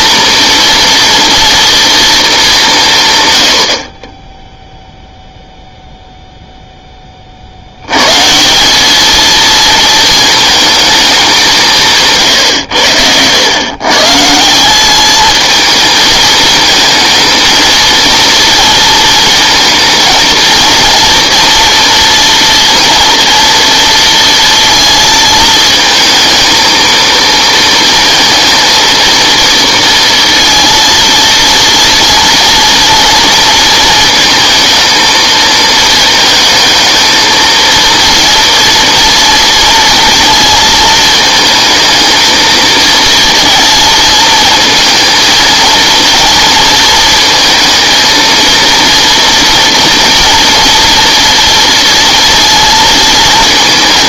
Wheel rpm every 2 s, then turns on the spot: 230, 190, 0, 0, 190, 220, 110, 180, 220, 230, 230, 230, 230, 230, 230, 230, 240, 230, 220, 230, 220, 230, 220, 230, 230, 230, 230.
none